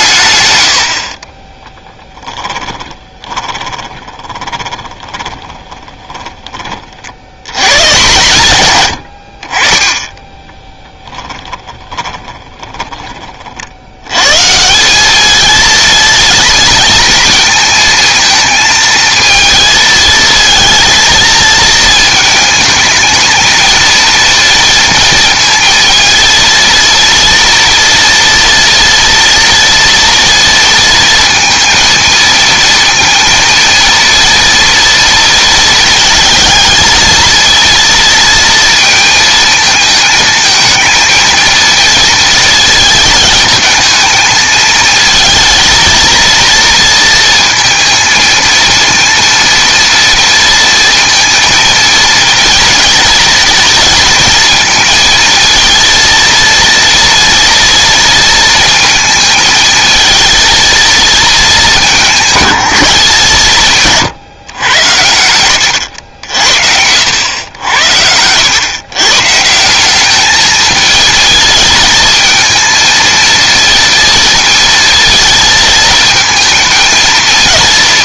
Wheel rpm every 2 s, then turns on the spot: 90, 20, 20, 50, 100, 20, 10, 180, 230, 230, 230, 220, 230, 230, 230, 230, 230, 230, 220, 230, 220, 230, 220, 230, 230, 230, 230, 220, 230, 230, 230, 190, 110, 70, 120, 220, 230, 220, 230.
2-6 10-14